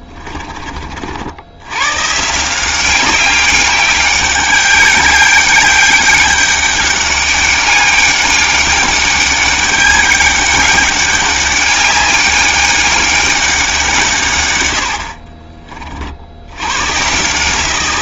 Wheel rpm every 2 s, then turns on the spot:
30, 170, 190, 200, 200, 200, 200, 100, 100.
none